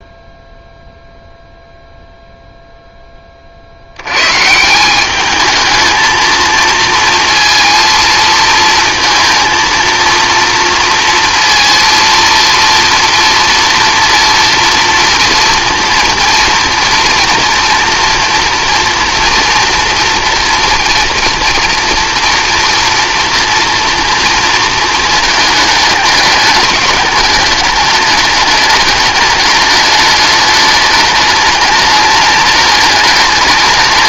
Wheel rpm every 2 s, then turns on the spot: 0, 0, 170, 230, 230, 230, 230, 230, 240, 240, 230, 230, 220, 210, 210, 210, 210.
none